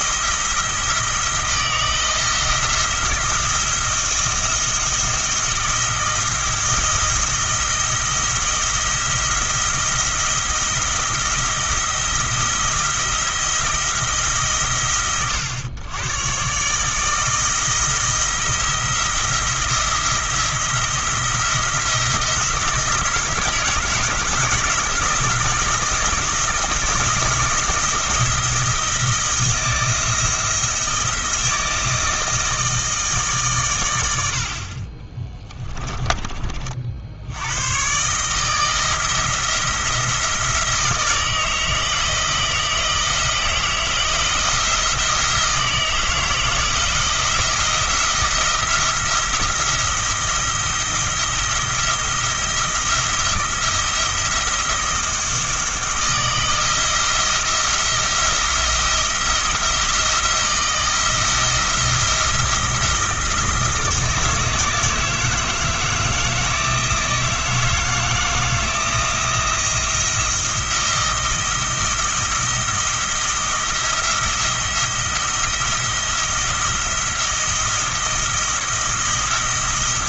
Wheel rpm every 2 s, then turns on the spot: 160, 170, 170, 170, 170, 170, 170, 130, 140, 170, 170, 160, 160, 160, 160, 160, 160, 50, 30, 160, 170, 160, 170, 160, 170, 170, 170, 170, 160, 170, 170, 170, 160, 160, 160, 170, 160, 170, 170, 170.
34-36